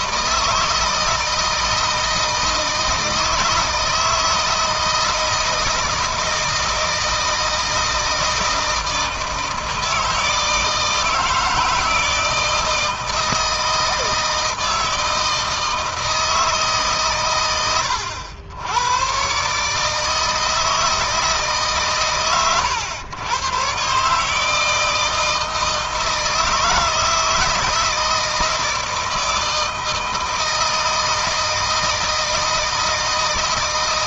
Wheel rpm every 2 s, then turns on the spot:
160, 160, 160, 160, 160, 160, 160, 160, 140, 100, 160, 110, 160, 170, 160, 160, 160.
none